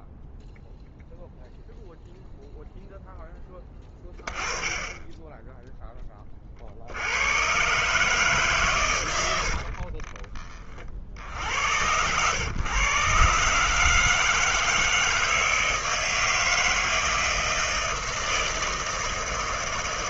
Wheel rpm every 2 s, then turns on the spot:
0, 0, 20, 40, 140, 30, 110, 160, 160, 160.
none